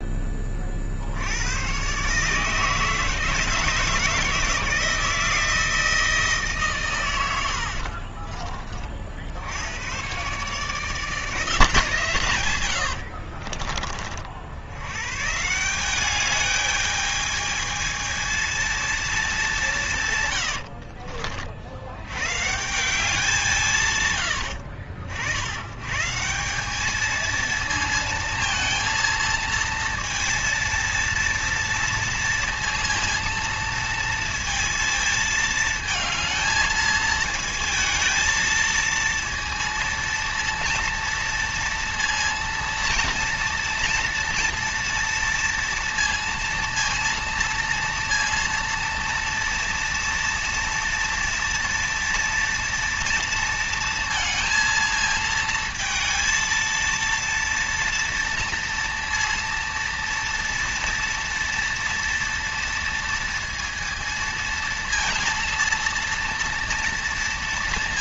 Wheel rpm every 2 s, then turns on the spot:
40, 160, 160, 130, 40, 150, 110, 90, 210, 230, 100, 160, 70, 180, 230, 230, 230, 230, 220, 230, 230, 230, 230, 230, 230, 230, 230, 230, 230, 230, 230, 230, 230, 230.
12-14 20-22